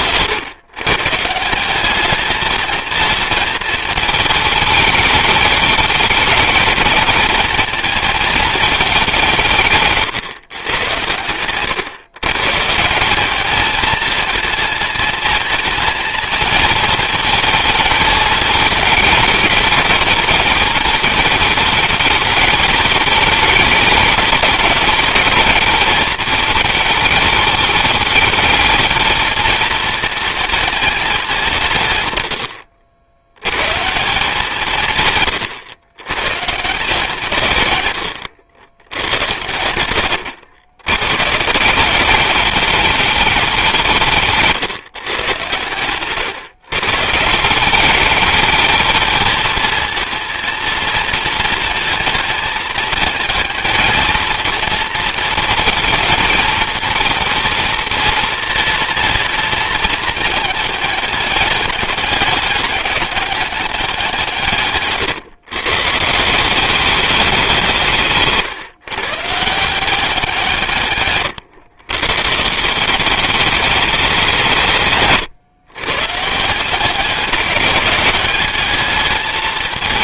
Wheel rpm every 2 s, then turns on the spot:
130, 220, 210, 210, 220, 120, 150, 220, 230, 220, 220, 200, 210, 220, 220, 220, 80, 160, 140, 100, 120, 200, 140, 130, 210, 230, 220, 230, 230, 230, 210, 200, 140, 190, 140, 150, 170, 170, 170, 210.
none